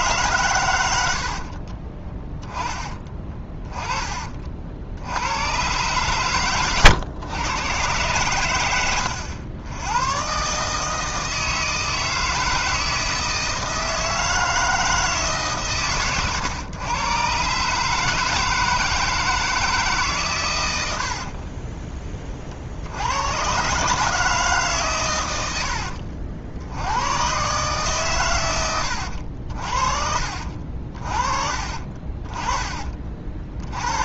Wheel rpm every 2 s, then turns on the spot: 110, 10, 50, 130, 100, 150, 160, 160, 120, 160, 110, 60, 150, 80, 100, 50, 30.
2-4 32-34